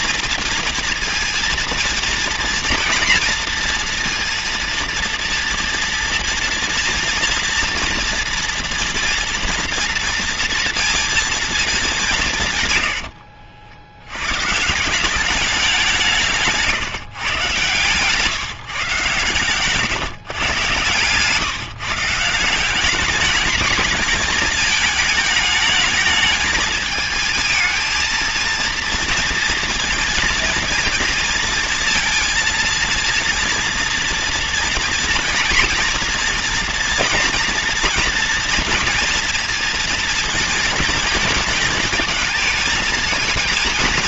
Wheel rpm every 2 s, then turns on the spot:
230, 240, 230, 230, 230, 230, 90, 180, 140, 130, 130, 190, 220, 220, 230, 230, 230, 230, 230, 230, 230, 230.
12-14